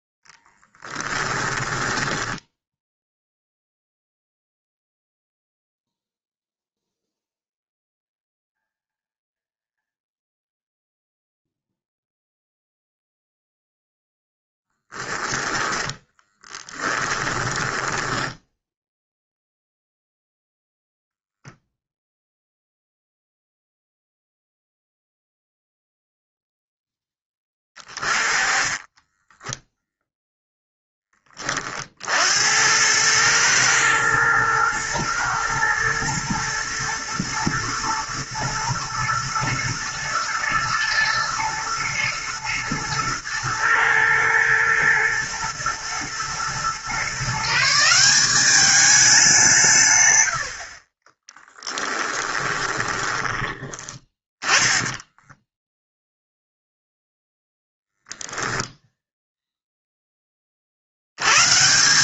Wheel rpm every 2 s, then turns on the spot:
0, 10, 0, 0, 0, 0, 0, 10, 10, 0, 0, 0, 0, 10, 10, 20, 110, 110, 110, 110, 120, 110, 110, 140, 200, 30, 20, 10, 0, 0, 70.
2-4 14-18 28-30 52-56